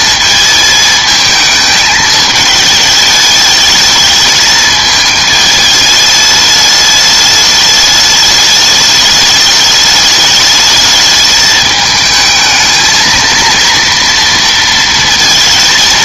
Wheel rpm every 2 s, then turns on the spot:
220, 220, 220, 210, 210, 210, 220, 230.
none